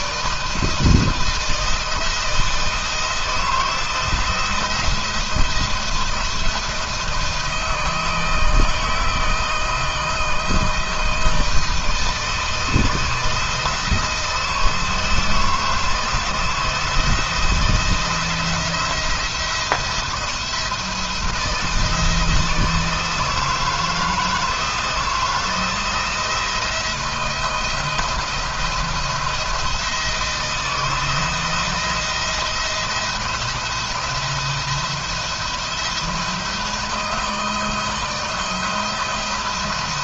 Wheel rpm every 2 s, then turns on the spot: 160, 160, 170, 170, 160, 160, 160, 160, 170, 170, 160, 160, 170, 170, 170, 160, 170, 170, 160, 170.
none